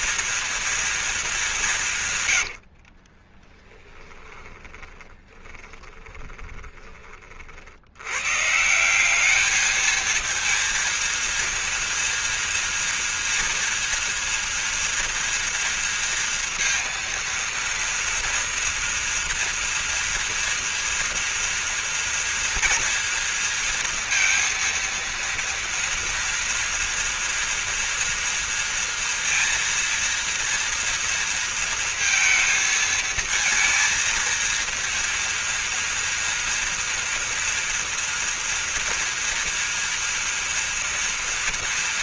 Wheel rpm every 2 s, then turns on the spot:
230, 70, 20, 20, 170, 230, 230, 240, 230, 230, 230, 240, 230, 230, 230, 240, 220, 230, 230, 230, 230.
2-8